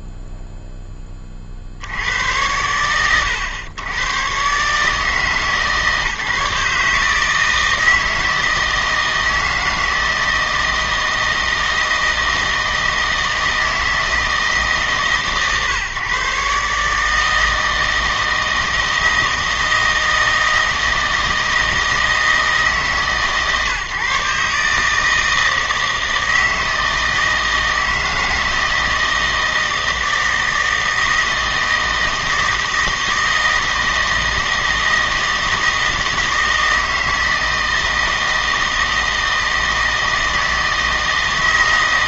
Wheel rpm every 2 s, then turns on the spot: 0, 100, 140, 150, 160, 160, 160, 150, 150, 160, 160, 150, 150, 160, 160, 160, 160, 160, 160, 160, 160.
none